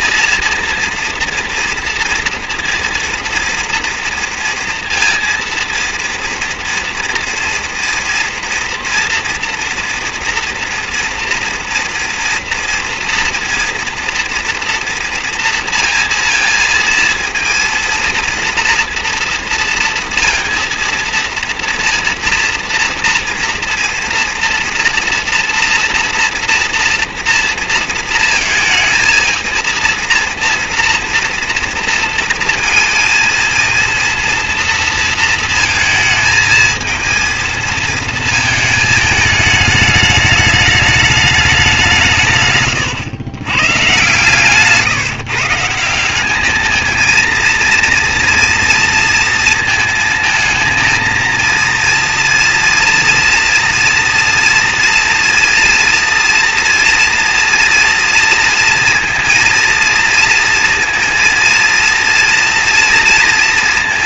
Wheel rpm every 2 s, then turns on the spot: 230, 230, 230, 230, 230, 230, 230, 230, 230, 230, 230, 230, 230, 230, 230, 230, 230, 230, 230, 220, 210, 130, 140, 210, 240, 220, 230, 230, 230, 230, 230, 230.
none